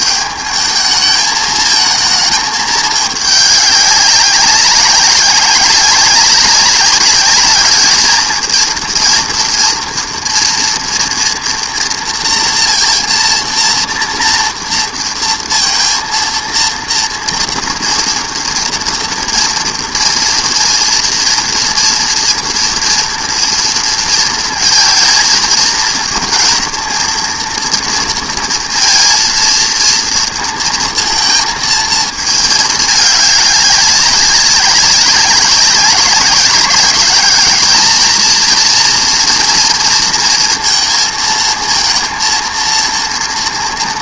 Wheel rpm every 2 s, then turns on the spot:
210, 220, 200, 190, 220, 240, 230, 230, 230, 230, 230, 230, 230, 230, 230, 230, 220, 190, 190, 230, 230, 230.
none